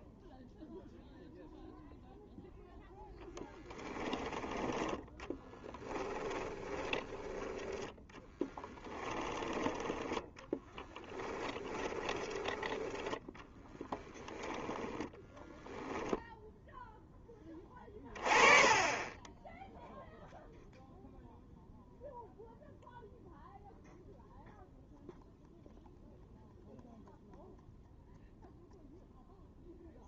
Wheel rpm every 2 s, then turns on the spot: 0, 0, 10, 20, 20, 10, 20, 10, 0, 30, 0, 0, 0, 0, 0.
6-12 14-16